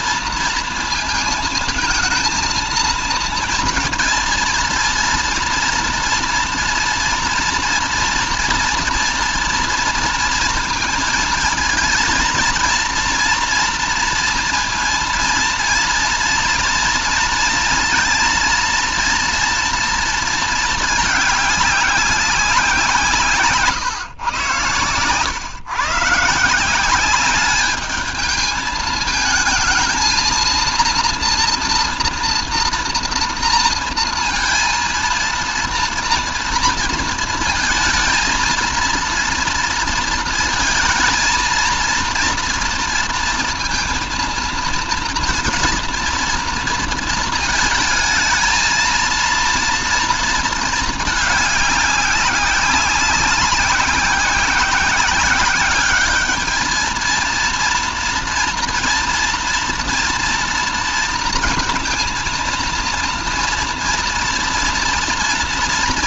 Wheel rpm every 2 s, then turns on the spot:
230, 220, 220, 230, 230, 230, 230, 230, 230, 230, 220, 180, 130, 170, 220, 230, 230, 230, 230, 230, 220, 230, 230, 230, 220, 220, 190, 190, 220, 230, 230, 230, 230.
none